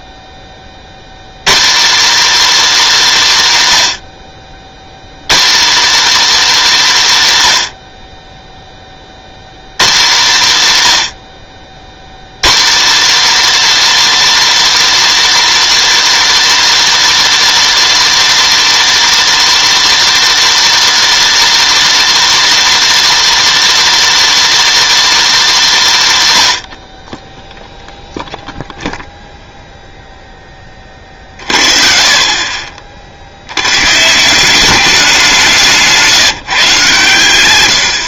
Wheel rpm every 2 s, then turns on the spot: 30, 280, 90, 260, 20, 150, 210, 310, 310, 310, 310, 310, 320, 110, 0, 20, 40, 190, 140.
none